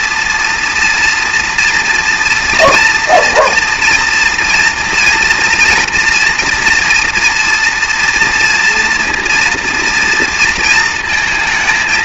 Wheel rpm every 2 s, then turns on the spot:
230, 240, 230, 230, 230, 230.
none